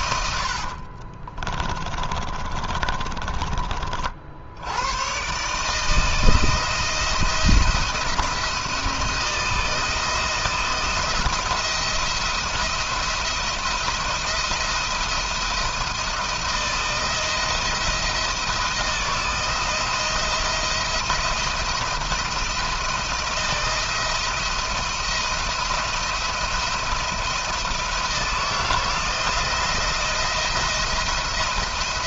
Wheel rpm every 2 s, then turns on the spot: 50, 30, 100, 170, 170, 170, 170, 160, 160, 170, 170, 170, 170, 170, 170, 170.
0-4